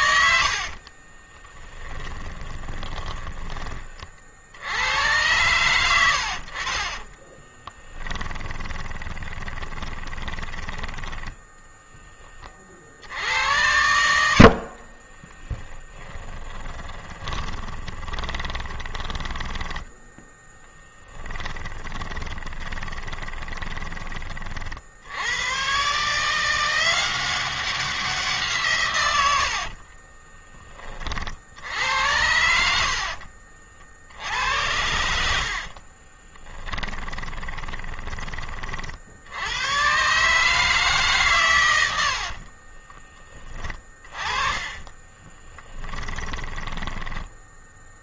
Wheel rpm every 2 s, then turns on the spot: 30, 10, 100, 30, 20, 20, 60, 20, 20, 10, 10, 20, 80, 180, 120, 40, 70, 70, 20, 50, 140, 30, 20, 10.
0-4 6-12 14-24 28-30 34-38 42-46